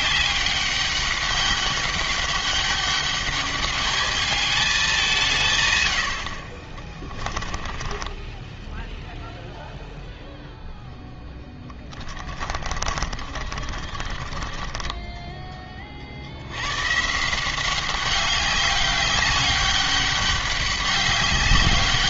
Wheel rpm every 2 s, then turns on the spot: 200, 200, 210, 40, 10, 0, 30, 30, 80, 190, 200.
8-10 12-16